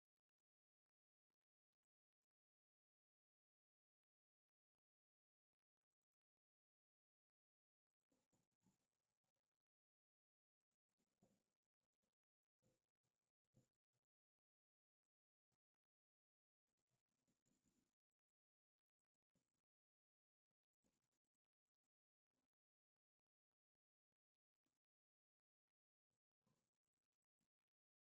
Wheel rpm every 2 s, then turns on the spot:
0, 0, 0, 0, 0, 0, 0, 0, 0, 0, 0, 0, 0, 0.
none